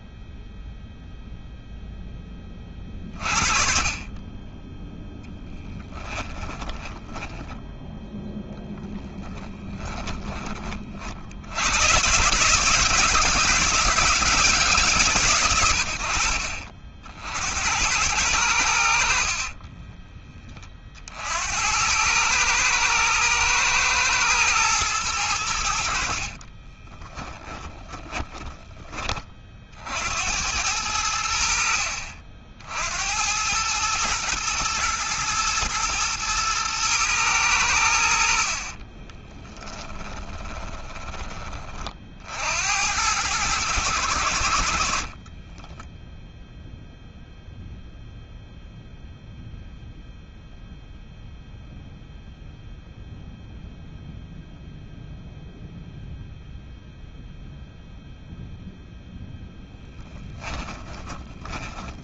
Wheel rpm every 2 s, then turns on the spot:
0, 40, 10, 10, 10, 50, 150, 130, 60, 40, 50, 110, 100, 20, 30, 80, 70, 120, 110, 30, 30, 90, 50, 0, 0, 0, 0, 0, 0, 0, 20.
6-10 18-20 26-28 38-40 60-62